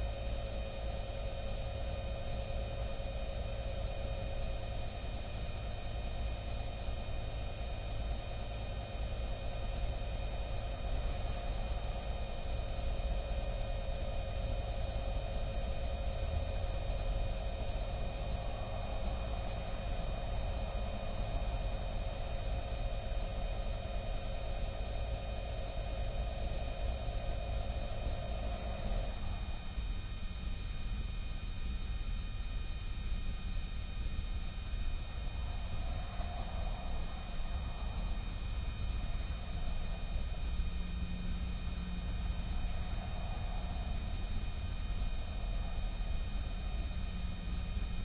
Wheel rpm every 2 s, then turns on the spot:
0, 0, 0, 0, 0, 0, 0, 0, 0, 0, 0, 0, 0, 0, 0, 0, 0, 0, 0, 0, 0, 0, 0, 0.
none